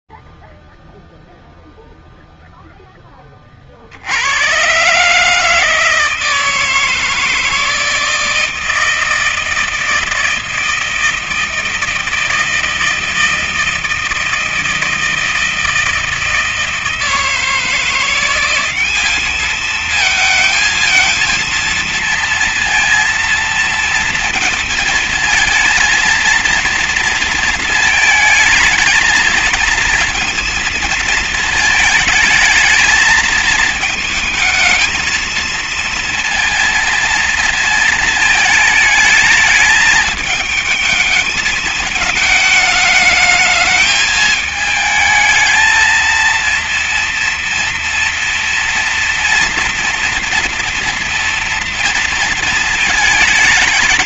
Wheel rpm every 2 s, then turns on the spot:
0, 0, 70, 160, 160, 160, 160, 160, 160, 180, 220, 230, 230, 230, 220, 230, 220, 220, 230, 220, 220, 220, 220, 220, 230, 240, 230.
none